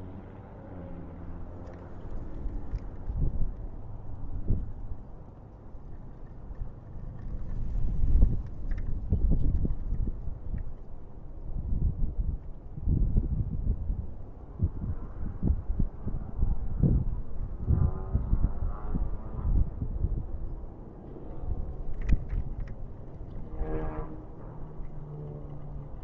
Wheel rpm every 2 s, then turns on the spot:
0, 0, 0, 0, 0, 0, 0, 0, 0, 0, 0, 0, 0.
none